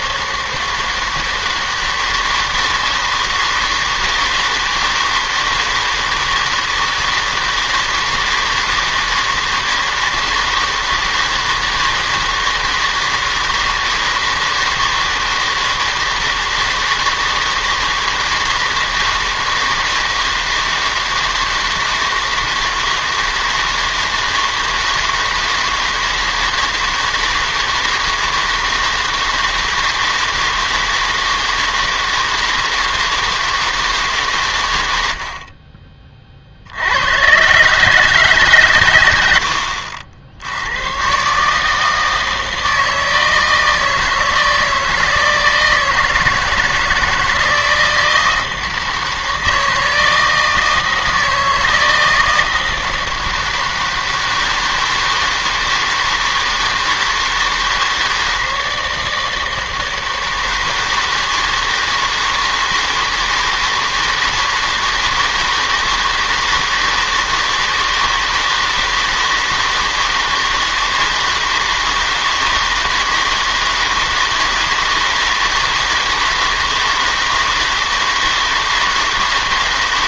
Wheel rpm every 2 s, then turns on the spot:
160, 160, 160, 160, 160, 160, 160, 160, 160, 160, 160, 160, 160, 160, 160, 160, 160, 110, 60, 140, 80, 160, 160, 160, 160, 160, 160, 160, 160, 160, 160, 160, 160, 160, 160, 160, 160, 160, 160, 160.
none